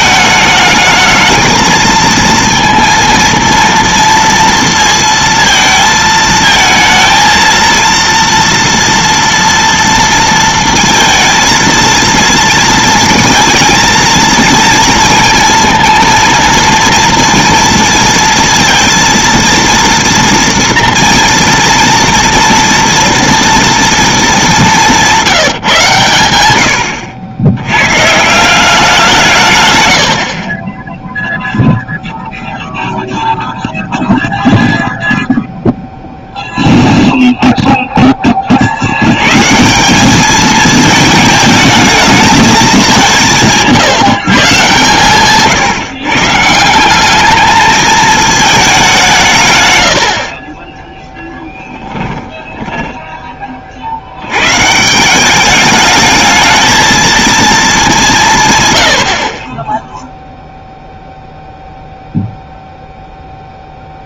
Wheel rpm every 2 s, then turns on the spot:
210, 230, 230, 220, 230, 230, 230, 230, 230, 230, 230, 230, 190, 100, 180, 30, 0, 0, 0, 50, 220, 210, 140, 170, 210, 30, 10, 130, 220, 120, 0, 0.
52-54